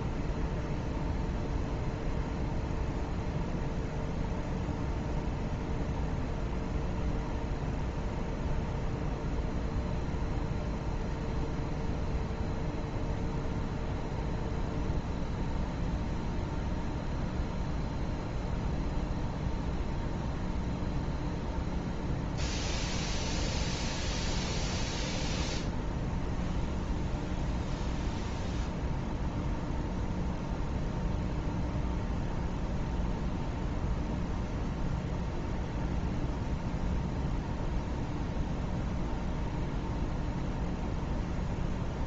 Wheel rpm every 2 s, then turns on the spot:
0, 0, 0, 0, 0, 0, 0, 0, 0, 0, 0, 0, 0, 0, 0, 0, 0, 0, 0, 0, 0.
none